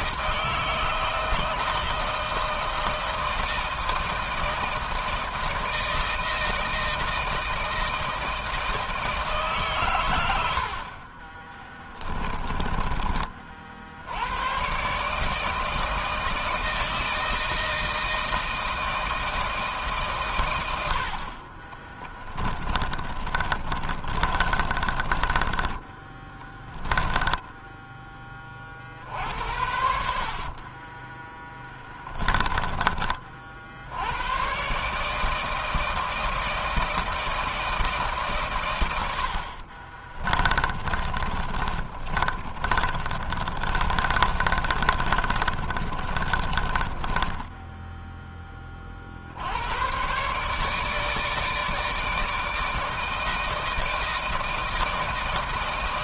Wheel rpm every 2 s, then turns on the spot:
160, 160, 160, 160, 160, 90, 20, 110, 160, 160, 130, 20, 30, 10, 30, 60, 20, 120, 160, 130, 30, 30, 30, 30, 10, 120, 160, 160.
12-14 22-28 30-34 40-48